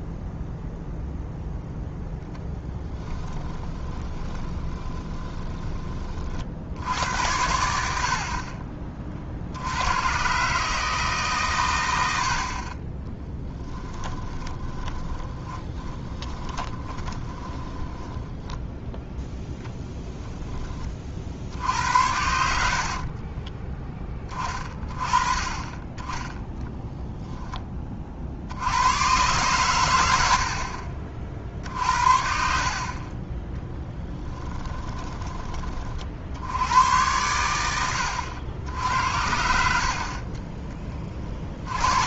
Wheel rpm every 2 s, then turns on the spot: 0, 10, 20, 60, 30, 140, 40, 10, 20, 10, 10, 80, 30, 10, 80, 60, 60, 20, 90, 80, 30.
2-6 14-18 22-24 34-36